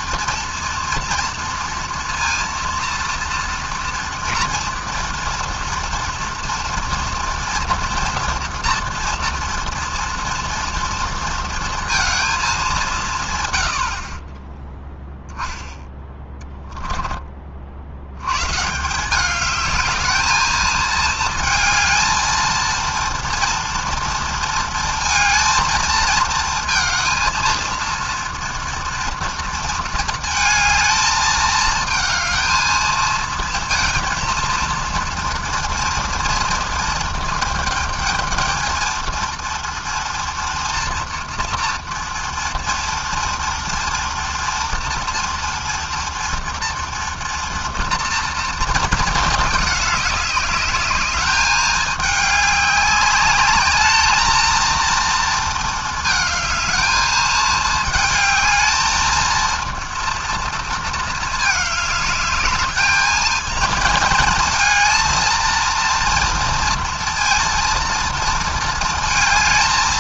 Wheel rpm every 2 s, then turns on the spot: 230, 230, 230, 230, 230, 230, 110, 10, 30, 200, 220, 230, 220, 220, 230, 220, 220, 230, 220, 230, 230, 230, 230, 230, 210, 210, 200, 230, 220, 230, 210, 220, 230, 230, 220.
none